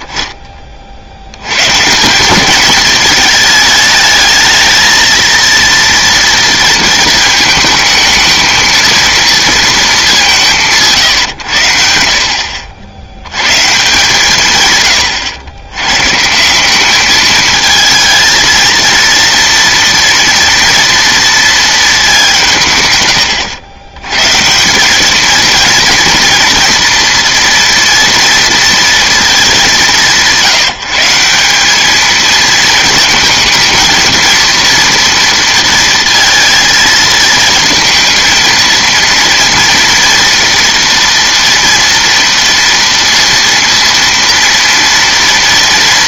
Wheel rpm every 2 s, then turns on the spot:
30, 180, 220, 230, 220, 180, 60, 150, 170, 220, 230, 180, 160, 230, 230, 170, 220, 230, 230, 230, 240, 230, 230.
none